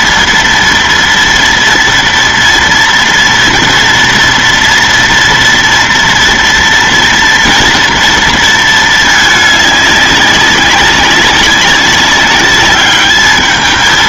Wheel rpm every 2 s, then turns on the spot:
230, 230, 230, 230, 220, 200, 200.
none